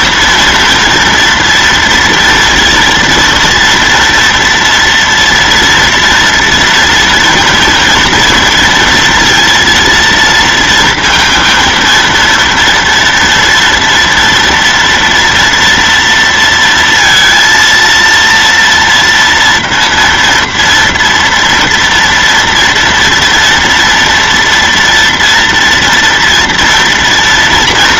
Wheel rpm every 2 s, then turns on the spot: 230, 230, 230, 240, 230, 230, 230, 230, 230, 230, 230, 230, 230, 230.
none